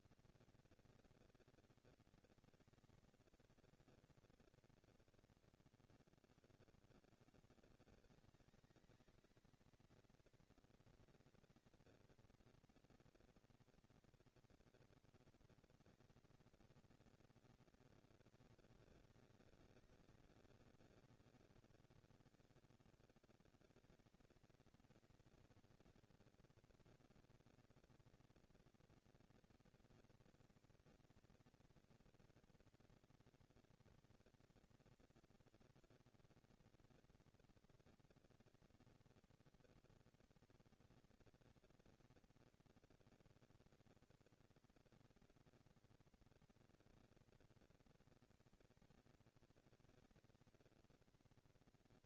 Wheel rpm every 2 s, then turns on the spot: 230, 230, 220, 120, 210, 230, 230, 230, 230, 210, 200, 200, 230, 240, 230, 230, 230, 230, 230, 230, 230, 230, 230, 230, 230, 230.
none